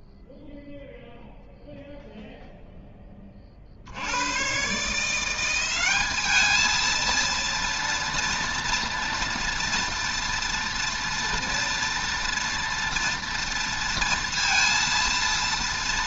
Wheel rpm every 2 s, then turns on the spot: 0, 0, 130, 220, 230, 230, 230, 230.
none